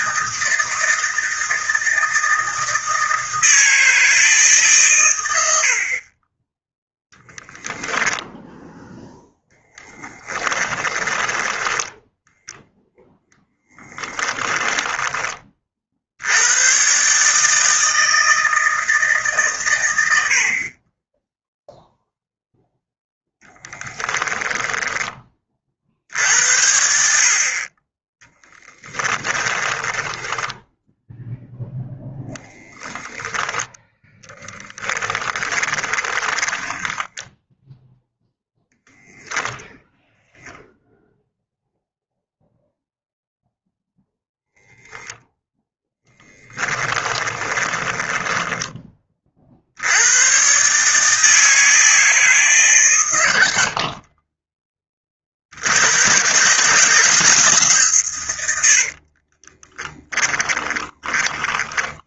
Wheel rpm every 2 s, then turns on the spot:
160, 160, 120, 0, 0, 20, 0, 10, 130, 160, 30, 0, 20, 70, 10, 0, 0, 10, 10, 0, 0, 0, 0, 10, 30, 150, 120, 20, 140, 60, 20.
10-12 24-26 28-30 34-36 46-48 58-62